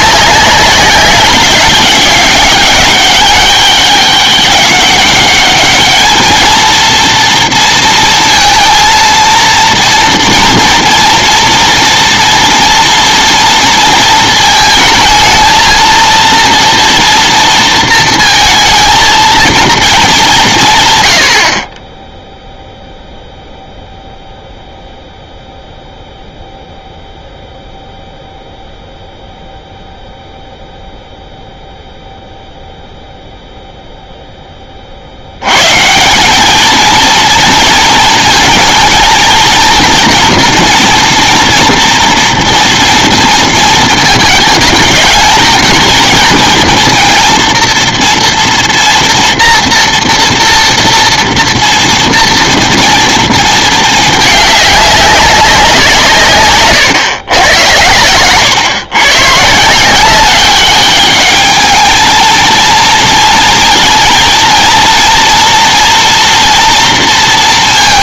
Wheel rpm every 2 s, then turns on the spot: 200, 200, 200, 230, 230, 230, 240, 220, 230, 230, 160, 0, 0, 0, 0, 0, 0, 20, 210, 220, 240, 230, 210, 230, 230, 230, 230, 210, 130, 120, 190, 230, 230, 230.
none